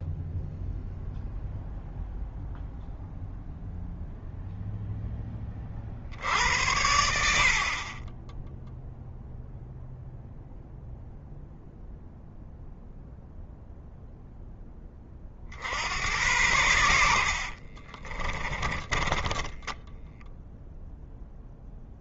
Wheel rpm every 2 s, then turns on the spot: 0, 0, 0, 70, 0, 0, 0, 10, 90, 20, 0.
16-20